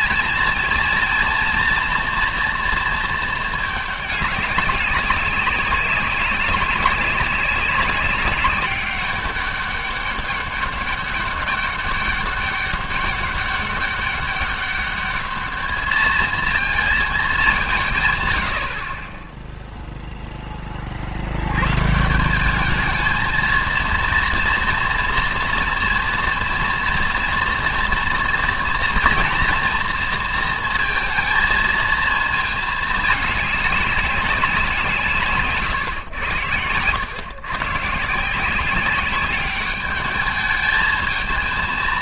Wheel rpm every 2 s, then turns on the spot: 230, 230, 190, 200, 200, 200, 200, 200, 230, 50, 30, 220, 230, 230, 230, 230, 220, 180, 110, 190, 220.
none